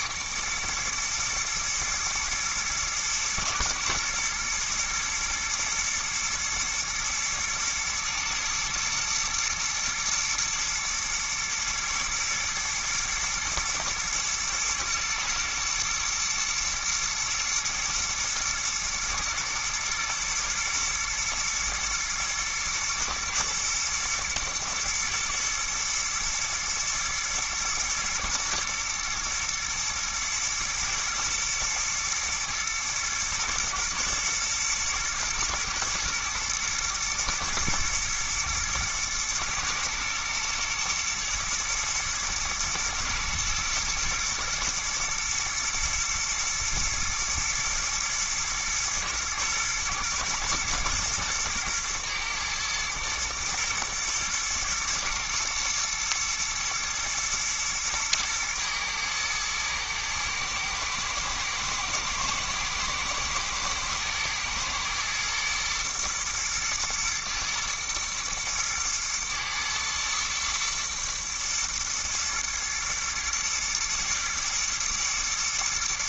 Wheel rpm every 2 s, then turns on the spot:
120, 110, 110, 110, 110, 120, 110, 120, 120, 110, 120, 120, 110, 110, 120, 110, 110, 110, 120, 110, 120, 120, 120, 110, 120, 120, 110, 110, 110, 110, 110, 110, 120, 110, 110, 110, 110, 110.
none